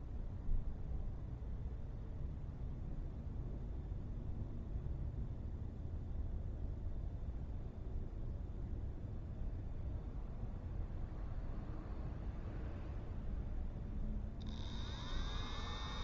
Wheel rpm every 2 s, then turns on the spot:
0, 0, 0, 0, 0, 0, 0, 0.
none